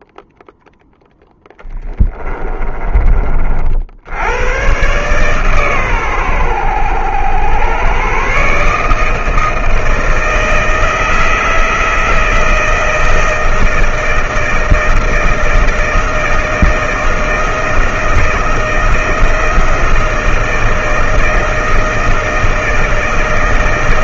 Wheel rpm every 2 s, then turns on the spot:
0, 20, 110, 100, 140, 160, 160, 160, 160, 160, 160, 160.
none